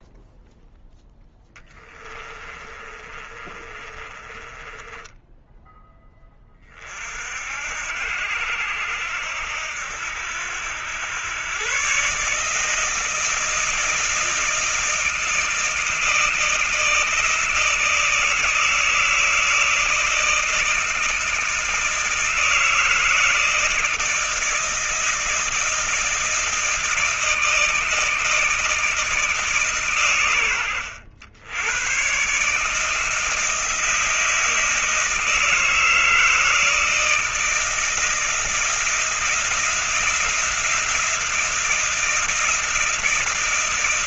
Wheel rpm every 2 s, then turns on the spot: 0, 30, 20, 30, 80, 90, 150, 160, 160, 160, 160, 160, 160, 160, 160, 100, 150, 160, 160, 170, 170, 160.
2-6